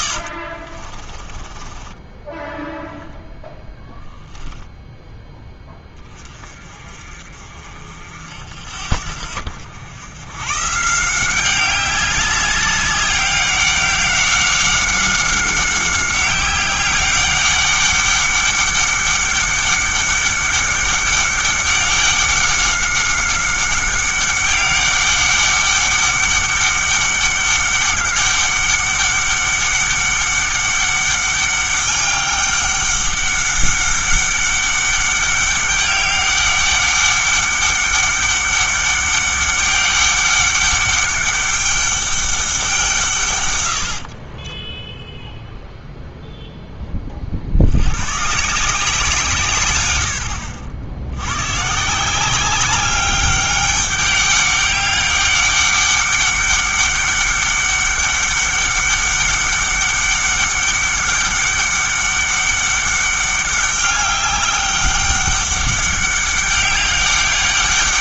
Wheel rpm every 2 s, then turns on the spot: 40, 0, 0, 30, 60, 140, 200, 190, 190, 190, 200, 190, 200, 200, 200, 200, 200, 200, 200, 200, 200, 180, 20, 10, 170, 80, 200, 200, 200, 200, 200, 200, 200, 200.
0-2 44-46